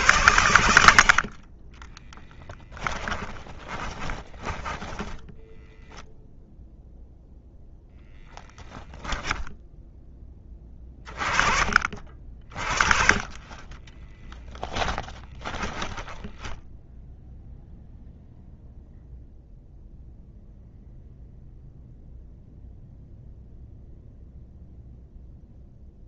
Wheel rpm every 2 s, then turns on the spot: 100, 10, 20, 0, 0, 20, 40, 10, 10, 0, 0, 0, 0.
2-6 14-18